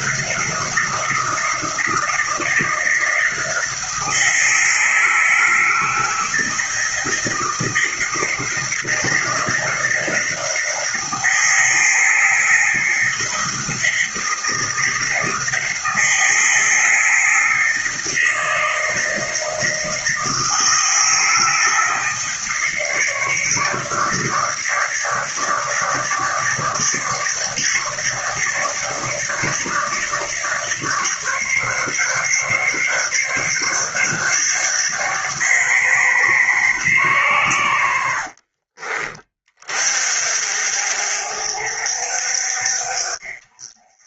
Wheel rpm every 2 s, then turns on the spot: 160, 160, 160, 160, 160, 170, 160, 160, 160, 160, 160, 160, 150, 150, 150, 150, 140, 140, 140, 50, 50, 60.
38-40